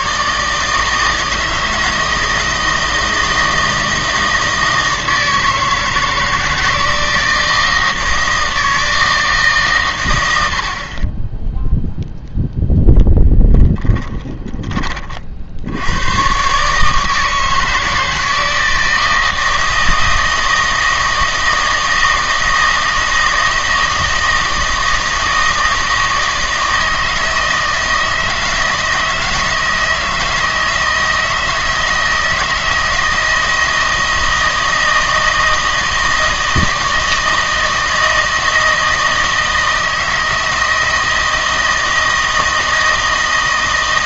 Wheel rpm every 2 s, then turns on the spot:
140, 160, 160, 160, 160, 80, 0, 30, 140, 160, 160, 160, 160, 160, 160, 160, 160, 160, 160, 160, 160, 160.
none